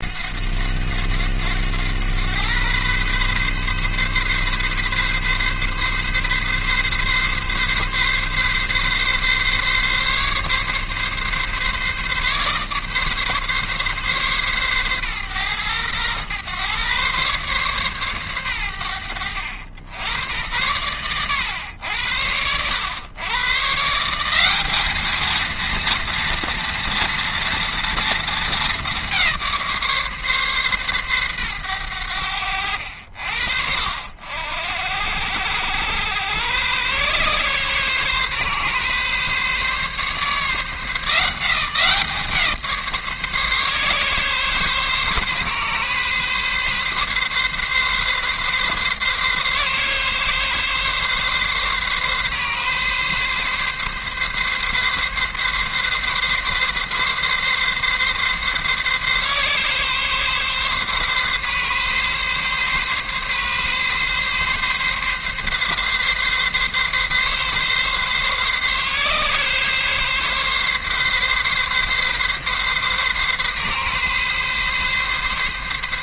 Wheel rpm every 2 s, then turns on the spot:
90, 120, 130, 140, 140, 140, 140, 120, 130, 90, 110, 110, 210, 230, 200, 130, 70, 80, 120, 140, 160, 150, 140, 140, 140, 130, 140, 140, 140, 140, 140, 140, 140, 140, 130, 140, 140, 140.
none